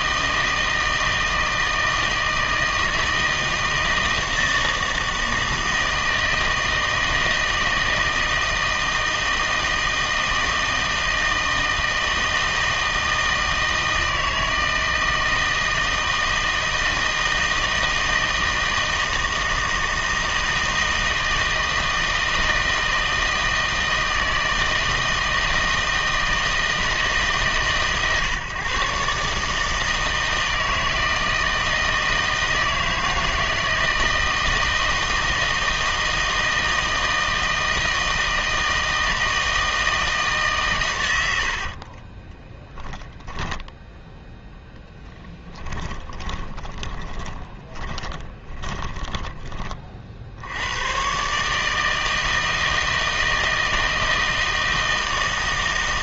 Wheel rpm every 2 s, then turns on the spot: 160, 160, 160, 160, 160, 160, 160, 160, 160, 160, 160, 160, 160, 160, 130, 160, 160, 160, 160, 160, 140, 20, 0, 20, 10, 100, 160, 160.
42-44 46-50